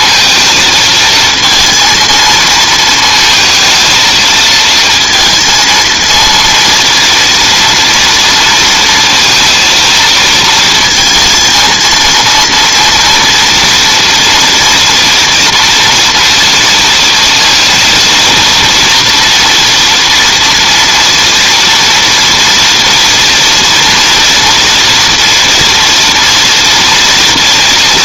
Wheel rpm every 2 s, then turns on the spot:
230, 230, 220, 230, 230, 230, 230, 230, 230, 230, 230, 240, 230, 230.
none